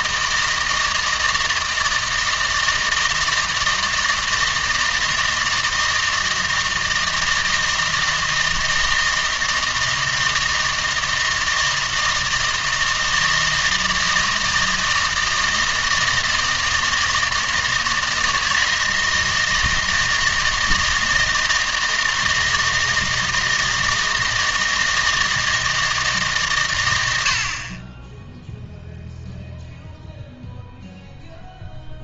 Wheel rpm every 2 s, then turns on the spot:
160, 160, 160, 160, 160, 160, 160, 160, 160, 160, 160, 160, 160, 120, 0, 0.
none